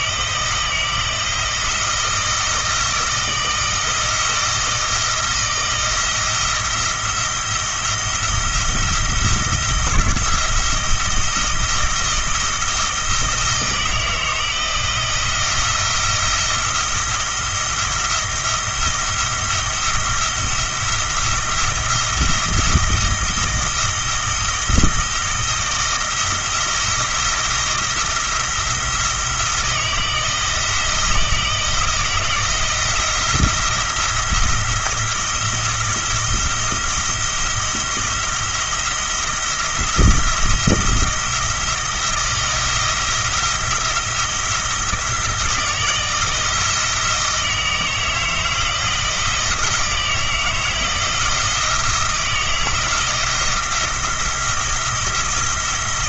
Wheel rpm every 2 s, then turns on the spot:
160, 160, 160, 170, 170, 170, 160, 160, 170, 170, 170, 170, 160, 160, 160, 170, 160, 170, 170, 170, 170, 170, 160, 160, 160, 160, 170, 170.
none